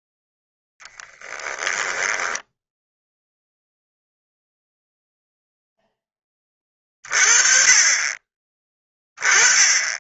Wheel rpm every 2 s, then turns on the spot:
10, 0, 0, 30, 20.
0-2